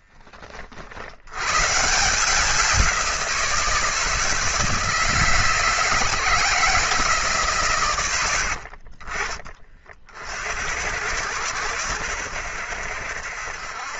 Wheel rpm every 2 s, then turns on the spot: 50, 180, 160, 160, 60, 80, 70.
8-10